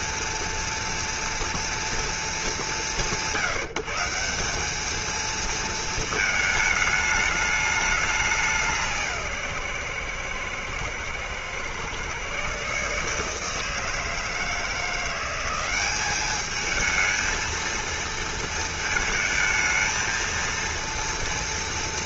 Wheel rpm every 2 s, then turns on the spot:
230, 140, 230, 210, 150, 120, 150, 180, 220, 220, 230.
none